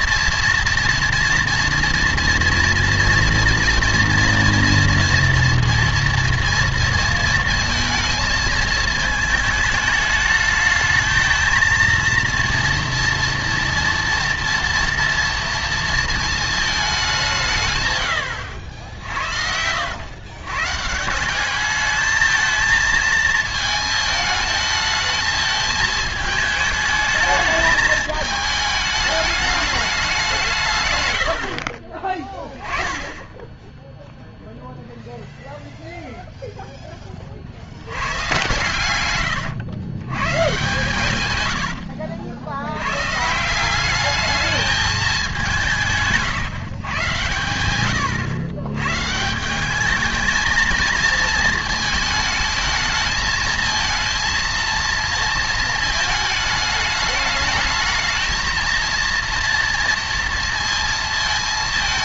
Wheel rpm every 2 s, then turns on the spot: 230, 230, 230, 230, 220, 220, 230, 230, 220, 80, 140, 220, 220, 220, 210, 140, 20, 0, 10, 110, 130, 90, 210, 150, 110, 220, 220, 230, 210, 230, 230.
none